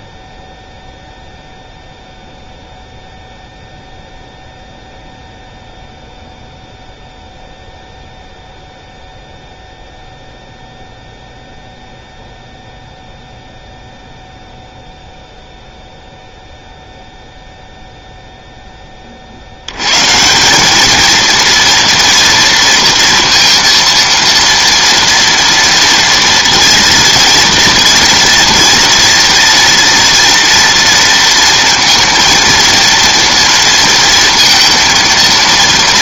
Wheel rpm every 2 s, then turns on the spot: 0, 0, 0, 0, 0, 0, 0, 0, 0, 10, 200, 230, 230, 230, 230, 230, 230, 230.
none